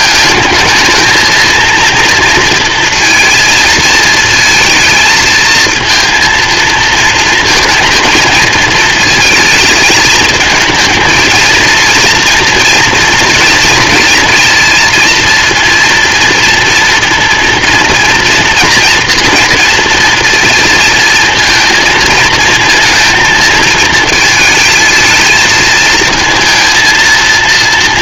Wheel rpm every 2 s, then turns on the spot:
220, 230, 220, 230, 230, 220, 230, 230, 230, 230, 230, 230, 230, 230.
none